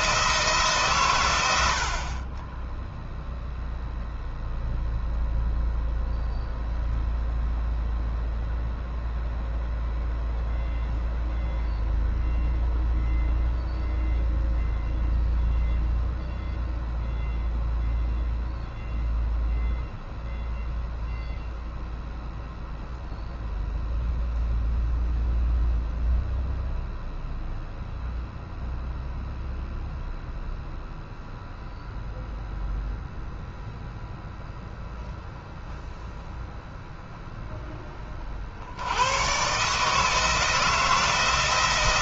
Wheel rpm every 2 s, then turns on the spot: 130, 0, 0, 0, 0, 0, 0, 0, 0, 0, 0, 0, 0, 0, 0, 0, 0, 0, 0, 100, 170.
none